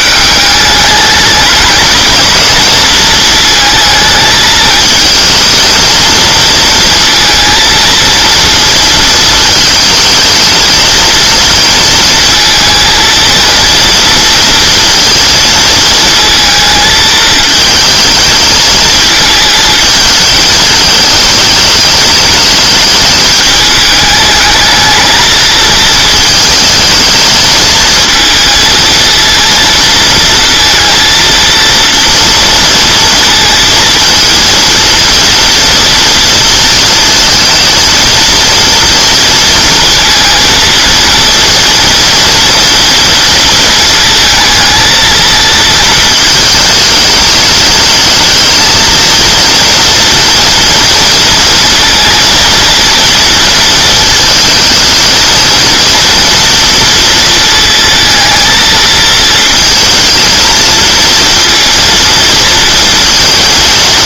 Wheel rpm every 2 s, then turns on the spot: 200, 220, 220, 230, 230, 220, 230, 230, 220, 220, 220, 210, 220, 220, 220, 230, 230, 230, 230, 230, 230, 230, 220, 220, 230, 230, 230, 220, 230, 230, 230, 230.
none